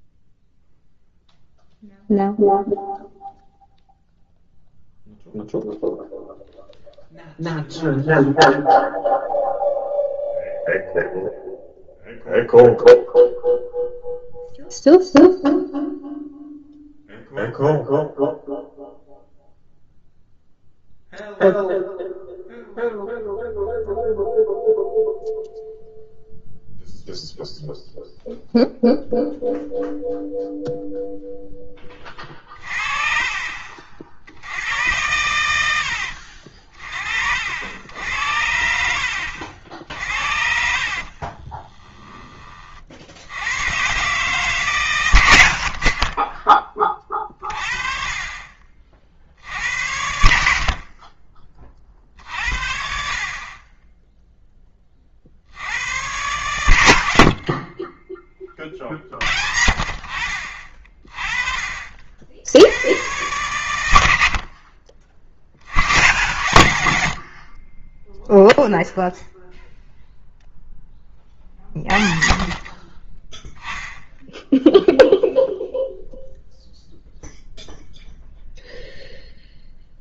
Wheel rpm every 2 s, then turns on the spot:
0, 0, 0, 0, 0, 0, 0, 0, 0, 0, 0, 0, 0, 0, 0, 0, 40, 80, 50, 60, 50, 30, 140, 20, 30, 60, 60, 10, 80, 30, 50, 80, 40, 90, 0, 10, 40, 0, 0, 0.
40-42